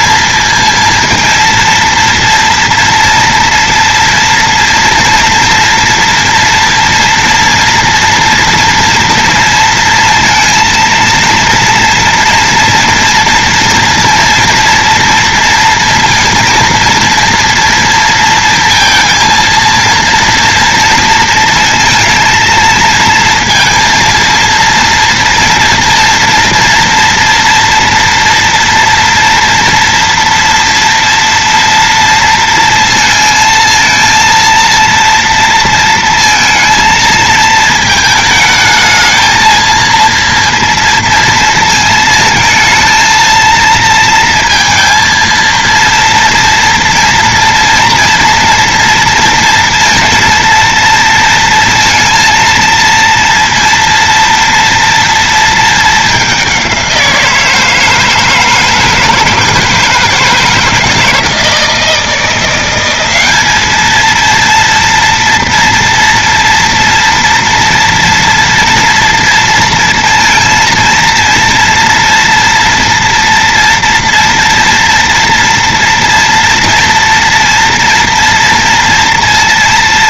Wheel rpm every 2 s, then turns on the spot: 230, 230, 230, 230, 230, 230, 230, 230, 230, 230, 230, 230, 230, 230, 230, 230, 230, 230, 220, 220, 230, 220, 230, 230, 230, 230, 230, 240, 190, 160, 160, 180, 230, 230, 230, 230, 230, 230, 230, 230.
none